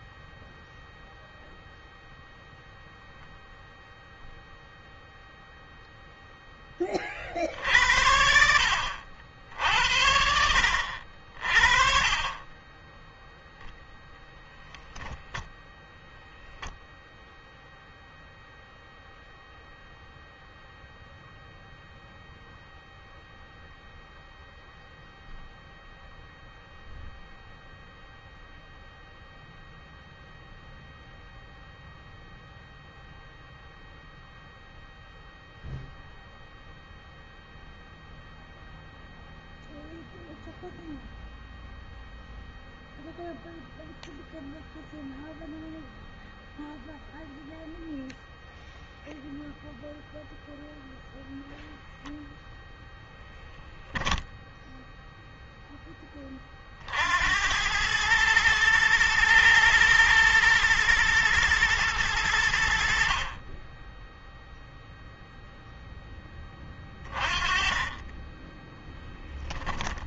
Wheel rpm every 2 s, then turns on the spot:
0, 0, 0, 30, 70, 70, 10, 0, 0, 0, 0, 0, 0, 0, 0, 0, 0, 0, 0, 0, 0, 0, 0, 0, 0, 0, 0, 0, 60, 110, 110, 60, 0, 30, 10.
none